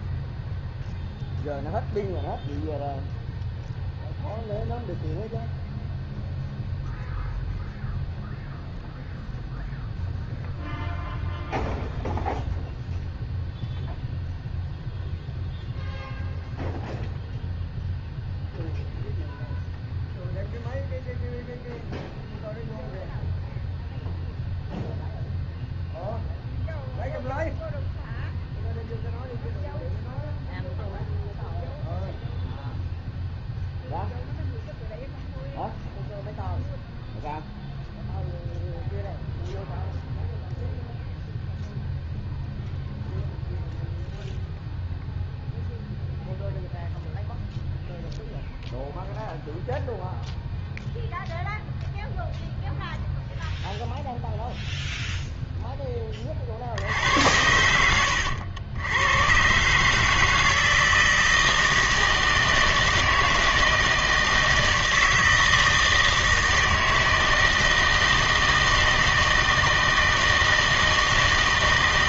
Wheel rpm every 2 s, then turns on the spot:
0, 0, 0, 0, 0, 0, 0, 0, 0, 0, 0, 0, 0, 0, 0, 0, 0, 0, 0, 0, 0, 0, 0, 0, 0, 0, 0, 0, 50, 90, 160, 160, 160, 160, 160, 160.
none